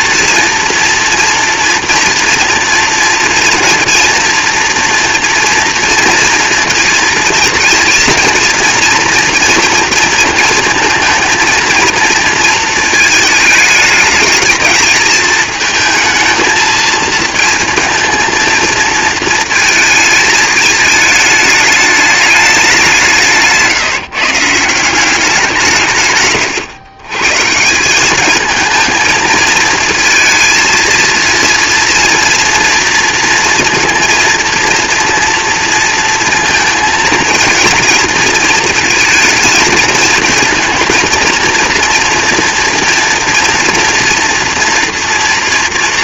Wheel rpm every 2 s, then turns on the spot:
230, 240, 230, 230, 230, 230, 220, 220, 220, 230, 220, 200, 170, 120, 220, 230, 230, 230, 230, 230, 230, 240, 230.
none